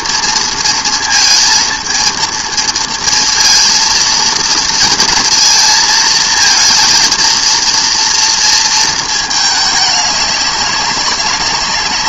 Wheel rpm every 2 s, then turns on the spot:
230, 230, 230, 230, 230, 200.
none